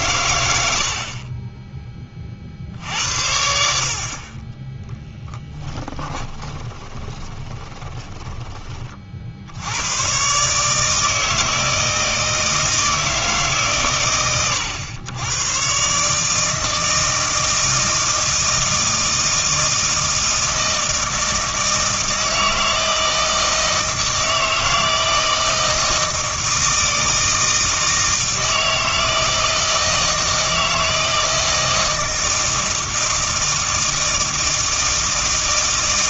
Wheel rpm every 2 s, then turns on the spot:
80, 60, 10, 20, 30, 150, 160, 110, 160, 160, 160, 160, 160, 160, 160, 160, 160, 160.
6-8